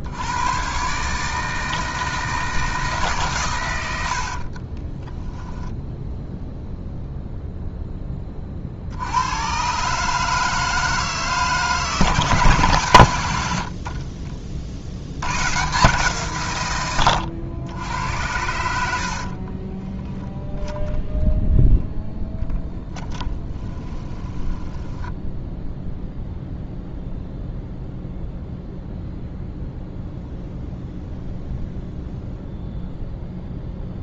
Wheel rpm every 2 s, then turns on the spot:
120, 160, 20, 0, 50, 160, 130, 70, 110, 60, 0, 10, 10, 0, 0, 0, 0.
4-6 22-26